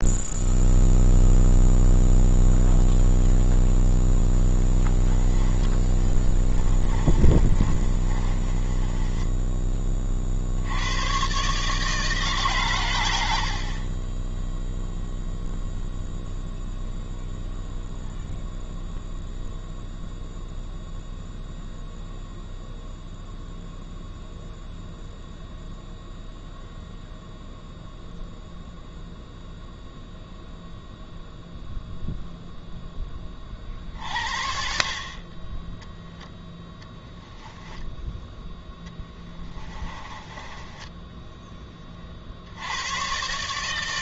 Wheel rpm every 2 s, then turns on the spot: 0, 0, 10, 20, 20, 70, 130, 0, 0, 0, 0, 0, 0, 0, 0, 0, 0, 60, 0, 0, 10, 90.
4-10 40-42